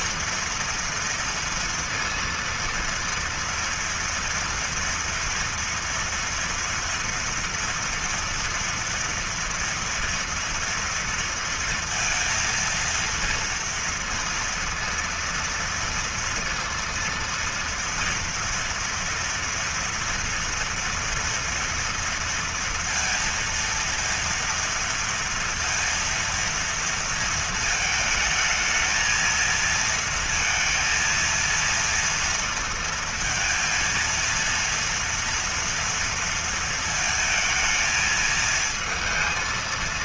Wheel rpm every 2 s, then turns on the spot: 230, 230, 230, 230, 230, 230, 230, 230, 230, 230, 230, 230, 230, 230, 220, 230, 230, 230, 230, 220.
none